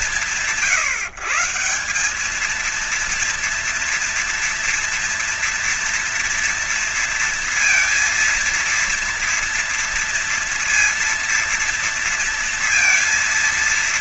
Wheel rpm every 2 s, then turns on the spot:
170, 220, 240, 230, 230, 230, 230.
none